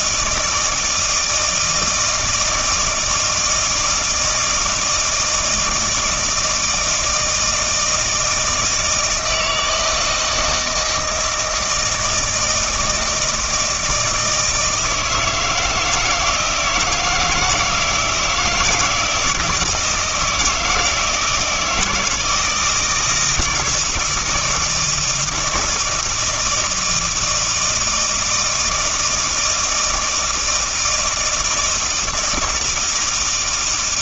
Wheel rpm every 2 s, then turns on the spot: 160, 160, 160, 160, 160, 160, 160, 160, 160, 170, 160, 160, 160, 160, 160, 160, 160.
none